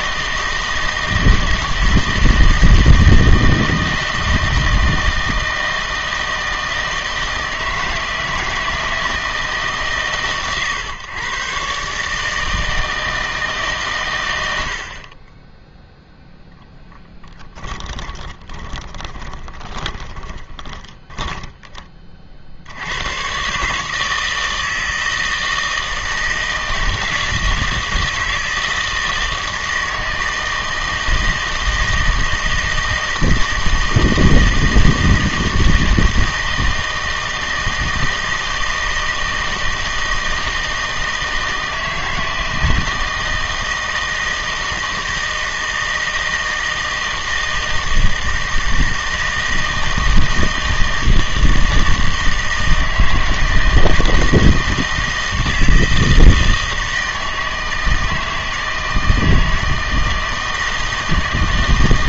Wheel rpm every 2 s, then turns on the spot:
160, 160, 160, 160, 160, 130, 160, 70, 10, 20, 20, 70, 160, 160, 160, 160, 160, 160, 160, 160, 160, 160, 160, 160, 160, 160, 160, 160, 160, 160, 160.
16-22